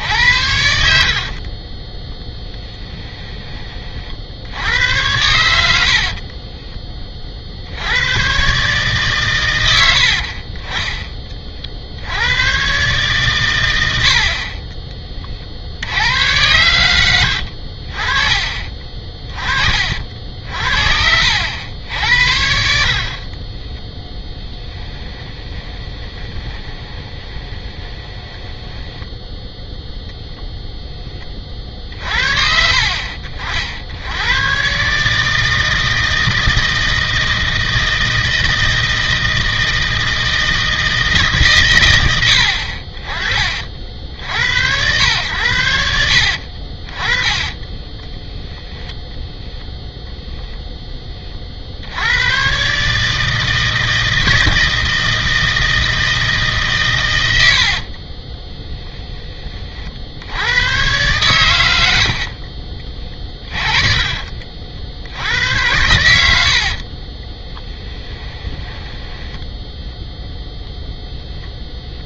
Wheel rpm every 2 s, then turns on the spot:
60, 10, 80, 20, 140, 20, 120, 20, 110, 30, 60, 50, 10, 20, 10, 10, 60, 130, 160, 160, 160, 40, 100, 50, 10, 10, 140, 160, 130, 10, 110, 40, 60, 50, 10, 0.
0-4 18-22 24-30 46-48 62-64 66-70